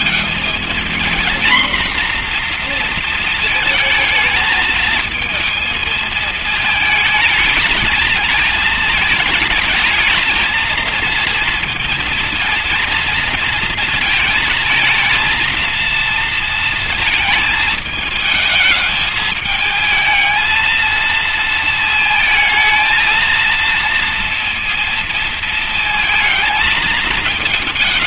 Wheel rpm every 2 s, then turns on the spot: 230, 230, 220, 220, 220, 220, 230, 220, 230, 220, 230, 220, 230, 220.
none